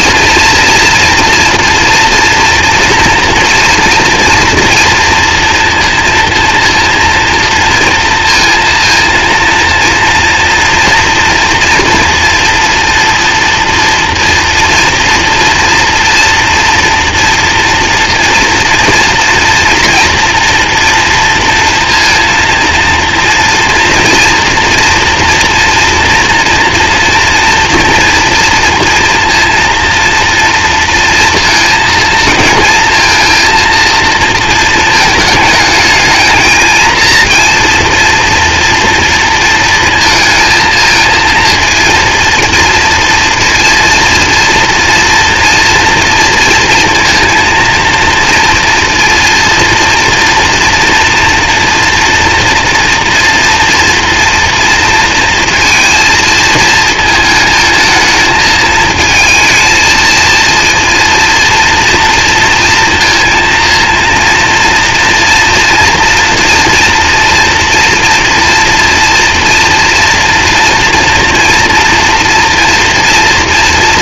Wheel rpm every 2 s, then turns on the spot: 230, 230, 240, 230, 230, 230, 230, 230, 240, 240, 230, 230, 230, 230, 230, 230, 230, 230, 220, 240, 230, 230, 230, 230, 230, 240, 240, 230, 220, 220, 230, 230, 230, 240, 230, 230, 230.
none